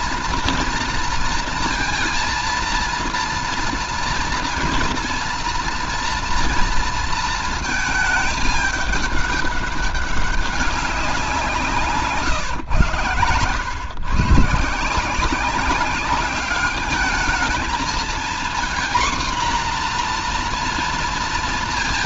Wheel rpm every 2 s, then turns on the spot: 230, 230, 230, 230, 210, 200, 120, 140, 200, 230, 240.
none